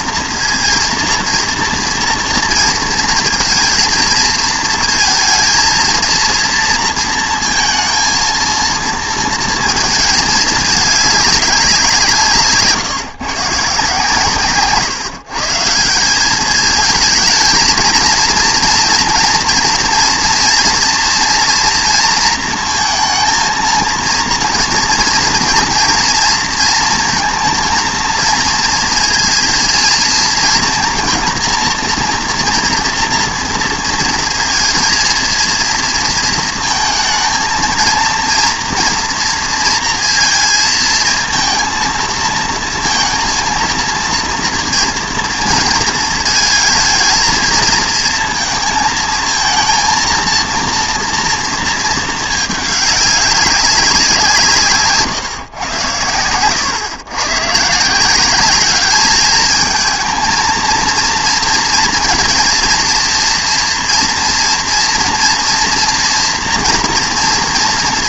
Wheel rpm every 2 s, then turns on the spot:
230, 230, 220, 230, 220, 210, 150, 140, 210, 230, 230, 230, 230, 230, 230, 230, 230, 230, 220, 240, 230, 230, 230, 230, 220, 230, 210, 140, 110, 210, 230, 230, 230, 240.
14-16